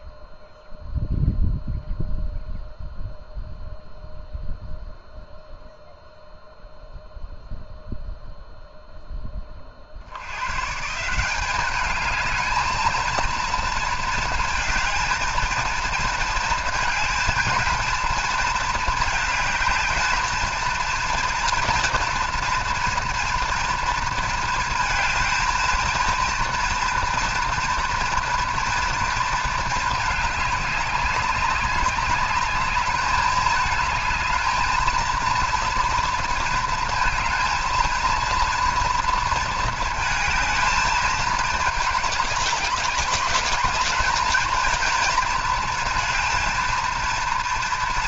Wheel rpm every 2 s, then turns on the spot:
0, 0, 0, 0, 0, 130, 220, 230, 220, 220, 220, 240, 230, 230, 230, 200, 200, 220, 230, 230, 220, 200, 220, 230.
none